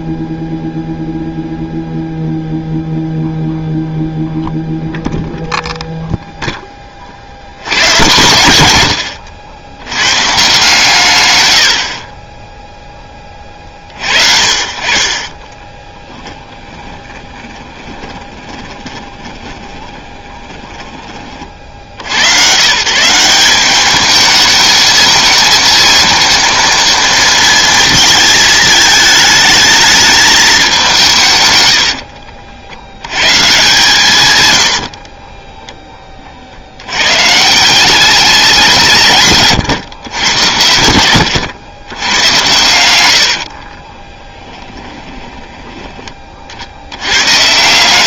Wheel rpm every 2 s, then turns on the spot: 0, 0, 0, 10, 120, 150, 10, 50, 20, 10, 10, 130, 220, 230, 220, 200, 80, 80, 80, 180, 80, 100, 20, 70.
14-20 34-36 44-46